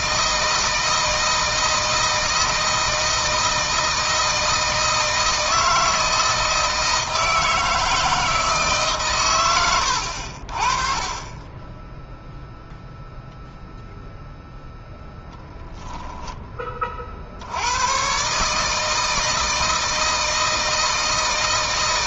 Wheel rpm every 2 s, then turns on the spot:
160, 160, 160, 160, 150, 30, 0, 0, 20, 150, 160.
none